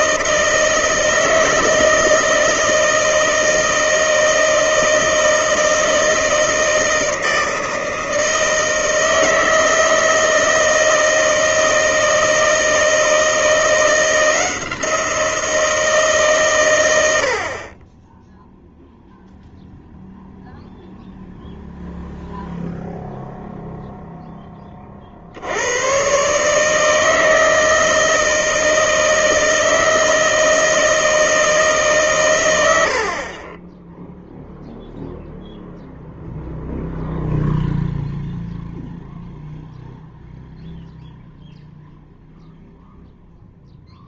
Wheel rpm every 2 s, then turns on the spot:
160, 160, 160, 160, 160, 160, 160, 170, 120, 0, 0, 0, 20, 150, 160, 160, 90, 0, 0, 0, 0, 0.
none